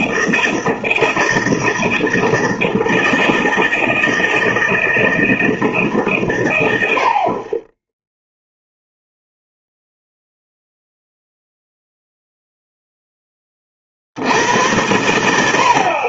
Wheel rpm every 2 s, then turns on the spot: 160, 160, 160, 80, 0, 0, 0, 100.
none